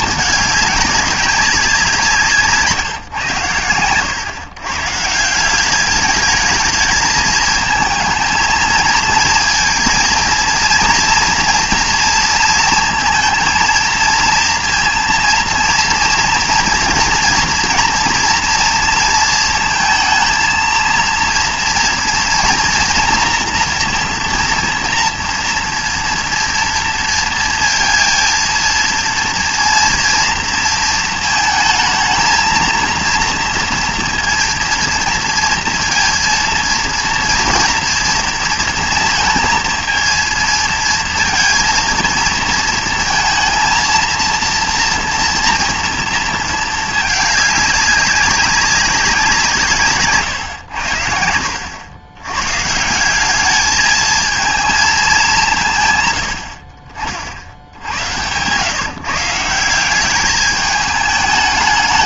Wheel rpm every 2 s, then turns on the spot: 200, 140, 130, 220, 220, 230, 230, 230, 230, 230, 230, 230, 230, 230, 230, 230, 230, 230, 230, 230, 220, 220, 230, 220, 190, 90, 150, 220, 50, 140, 210.
none